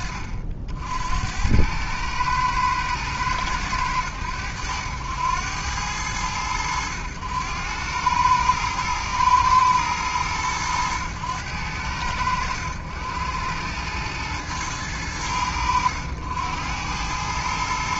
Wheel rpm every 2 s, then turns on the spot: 50, 110, 90, 90, 110, 100, 90, 100, 100.
none